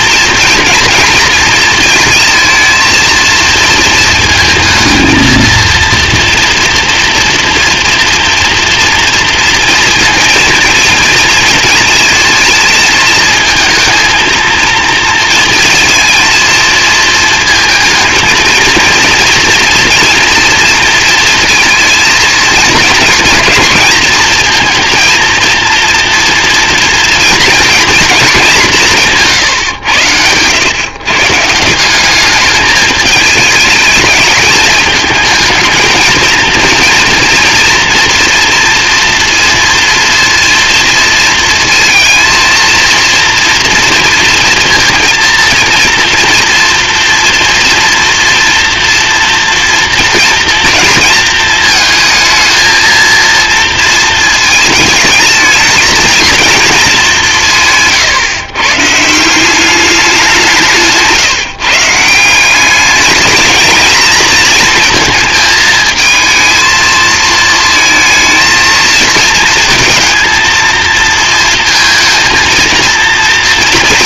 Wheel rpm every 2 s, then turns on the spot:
230, 230, 220, 230, 230, 230, 230, 230, 220, 230, 230, 230, 230, 240, 210, 110, 210, 210, 220, 230, 230, 230, 230, 230, 230, 230, 220, 220, 220, 130, 160, 190, 220, 220, 220, 230, 230.
none